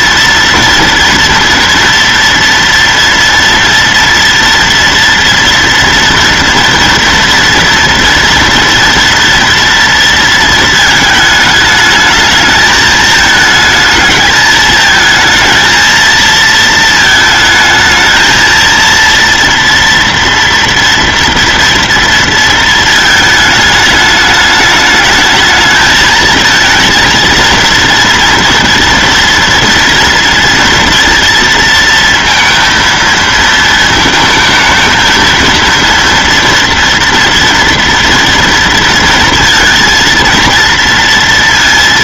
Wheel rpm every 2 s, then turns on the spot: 230, 230, 230, 230, 240, 220, 210, 220, 220, 230, 230, 220, 210, 220, 240, 230, 230, 220, 240, 230, 230.
none